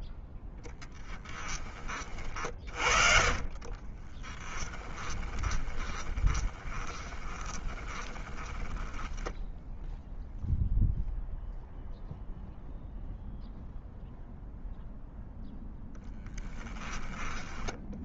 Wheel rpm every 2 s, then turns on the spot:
0, 40, 20, 20, 10, 0, 0, 0, 10.
2-10 16-18